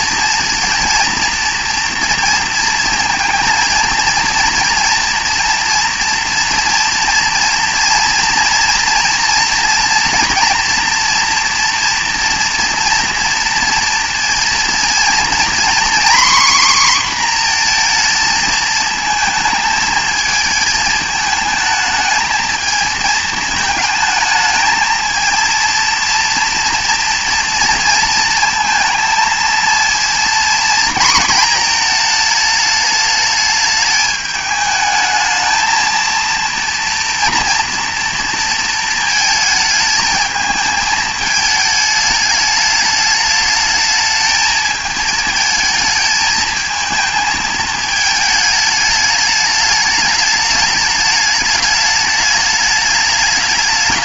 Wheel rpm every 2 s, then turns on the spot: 230, 230, 230, 230, 240, 230, 230, 230, 260, 220, 220, 220, 220, 230, 230, 230, 220, 210, 230, 230, 220, 210, 220, 220, 210, 210, 210.
none